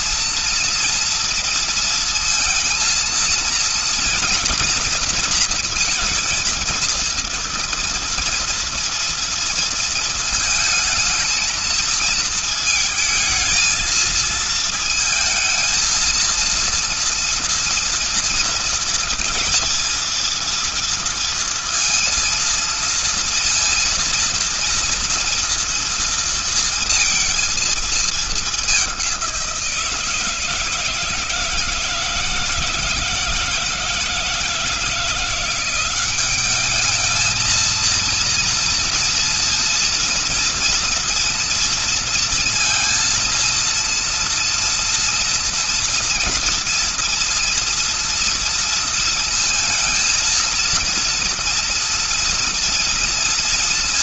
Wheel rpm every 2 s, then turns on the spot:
230, 230, 230, 230, 230, 230, 220, 230, 230, 230, 230, 230, 230, 230, 190, 160, 160, 170, 210, 240, 240, 230, 230, 230, 230, 230, 230.
none